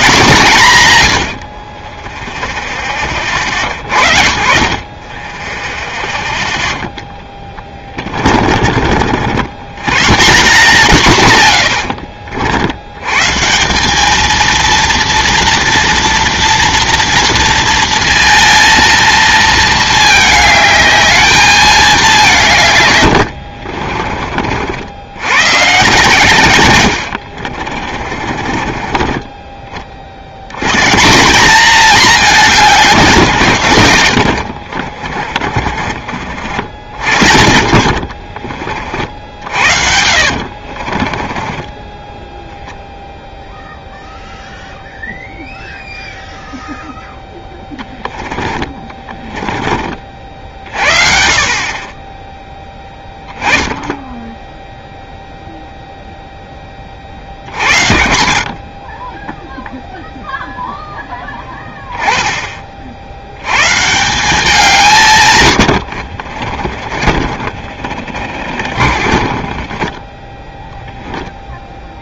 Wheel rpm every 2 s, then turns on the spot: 160, 10, 50, 0, 30, 150, 80, 230, 230, 230, 220, 140, 60, 90, 30, 120, 200, 50, 70, 40, 50, 0, 0, 0, 20, 60, 10, 0, 20, 40, 0, 30, 180, 40, 40, 10.
0-2 8-10 26-30 34-36 38-42 48-50 66-70